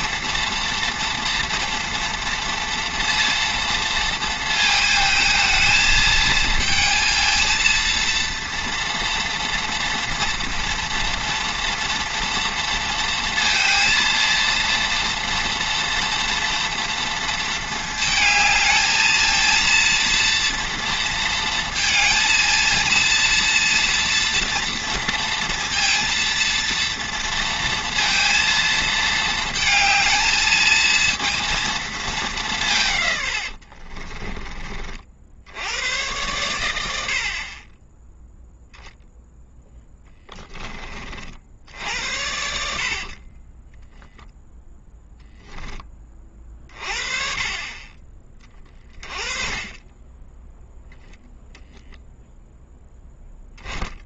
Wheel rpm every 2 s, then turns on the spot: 230, 230, 220, 230, 230, 230, 230, 230, 230, 220, 230, 230, 240, 230, 230, 220, 150, 40, 80, 0, 30, 60, 10, 40, 30, 0, 0.
42-44